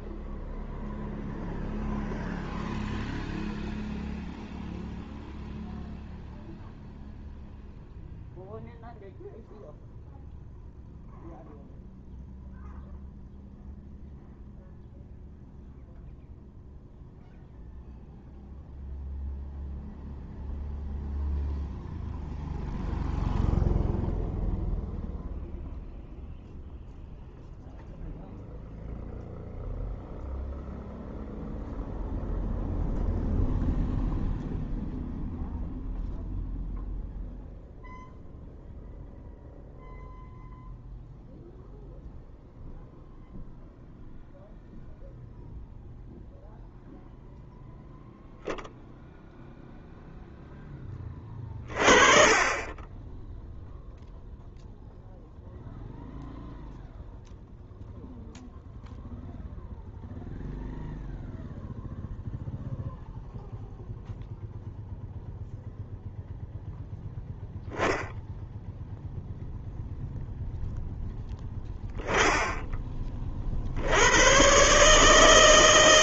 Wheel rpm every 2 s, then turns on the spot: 0, 0, 0, 0, 0, 0, 0, 0, 0, 0, 0, 0, 0, 0, 0, 0, 0, 0, 0, 0, 0, 0, 0, 0, 0, 10, 20, 0, 0, 0, 0, 0, 0, 0, 0, 0, 10, 130.
none